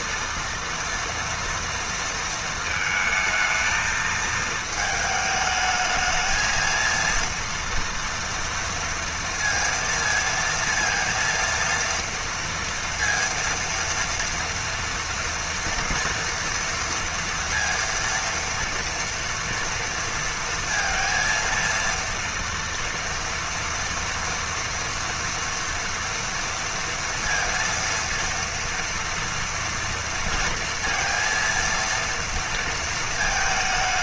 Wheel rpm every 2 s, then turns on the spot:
230, 220, 220, 230, 230, 230, 230, 230, 230, 230, 230, 230, 230, 230, 230, 230, 230.
none